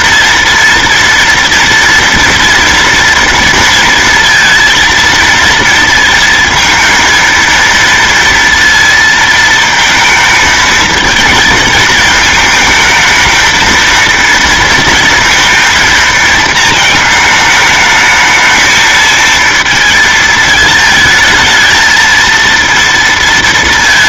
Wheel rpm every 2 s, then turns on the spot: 230, 230, 230, 230, 230, 220, 220, 220, 220, 220, 220, 230.
none